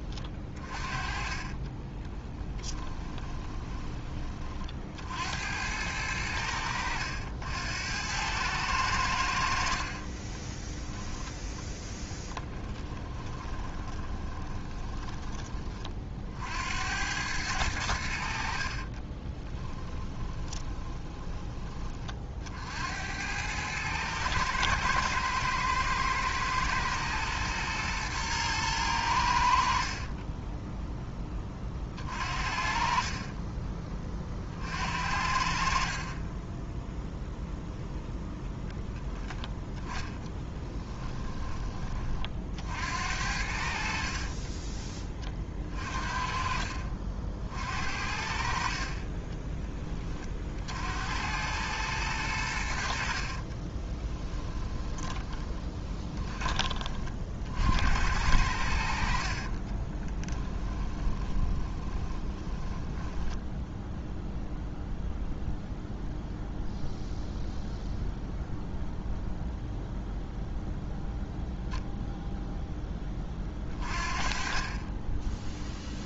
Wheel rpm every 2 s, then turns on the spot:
30, 10, 50, 90, 90, 10, 10, 20, 80, 40, 30, 80, 110, 110, 100, 10, 40, 50, 0, 0, 10, 60, 20, 50, 30, 70, 70, 20, 30, 60, 10, 10, 0, 0, 0, 0, 20, 20.
0-4 12-16 18-22 54-56 60-64